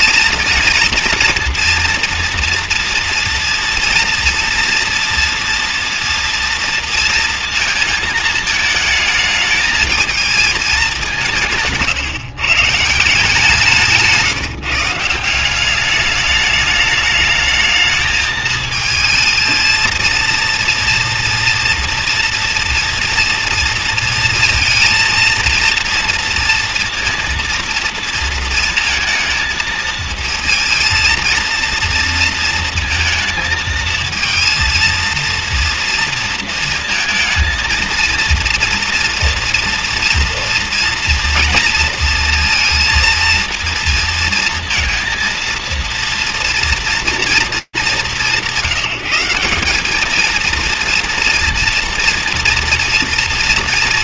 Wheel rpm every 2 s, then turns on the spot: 230, 230, 230, 230, 220, 190, 160, 170, 210, 220, 230, 230, 220, 230, 230, 230, 230, 230, 230, 230, 230, 230, 230, 230, 180, 230, 230.
none